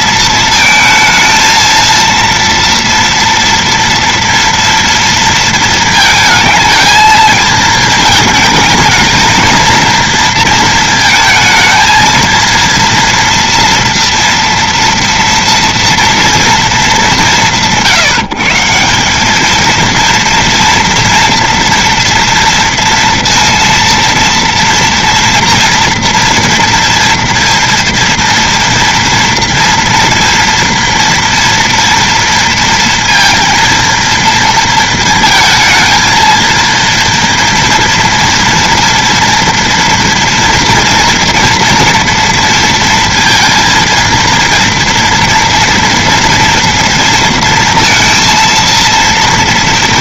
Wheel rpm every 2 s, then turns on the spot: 230, 230, 230, 220, 220, 230, 230, 230, 230, 160, 230, 230, 230, 230, 230, 230, 230, 230, 230, 230, 240, 230, 230, 230, 230.
none